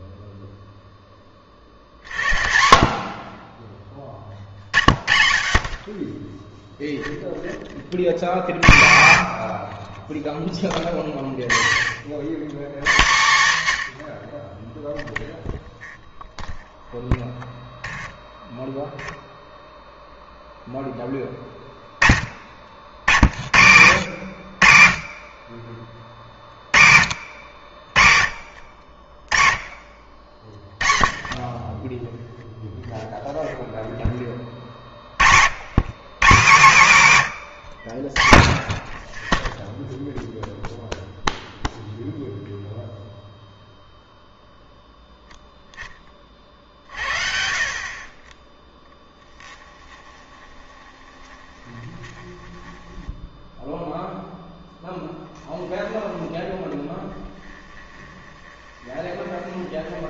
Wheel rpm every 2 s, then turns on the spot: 0, 60, 40, 10, 100, 30, 140, 0, 0, 0, 0, 70, 70, 60, 50, 30, 0, 40, 160, 10, 0, 0, 0, 60, 10, 20, 10, 0, 10, 20.
50-54 58-60